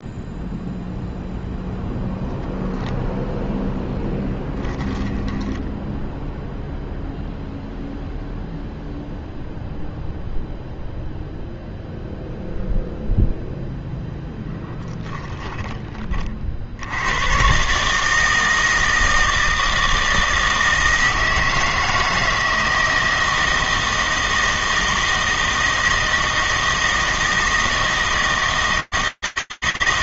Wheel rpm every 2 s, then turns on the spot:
0, 0, 10, 0, 0, 0, 0, 10, 70, 160, 160, 170, 160, 160, 160.
4-6 14-16